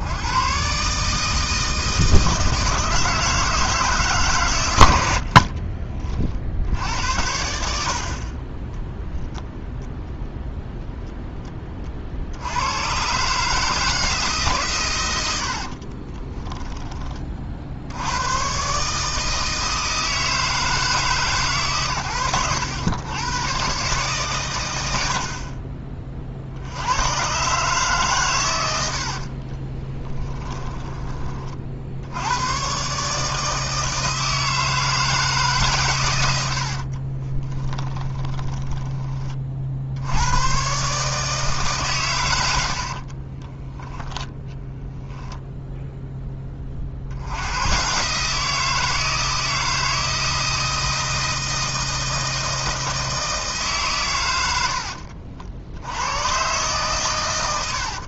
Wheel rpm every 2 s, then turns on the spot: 130, 160, 100, 70, 10, 0, 110, 130, 20, 140, 150, 100, 80, 90, 90, 20, 130, 160, 60, 20, 140, 60, 10, 40, 160, 160, 160, 70, 130.
28-32 36-38 42-44